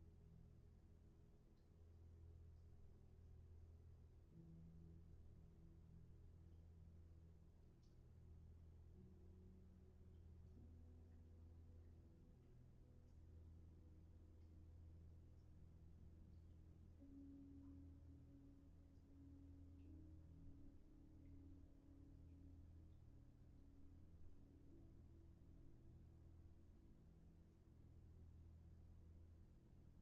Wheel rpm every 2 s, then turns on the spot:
0, 0, 0, 0, 0, 0, 0, 0, 0, 0, 0, 0, 0, 0, 0.
none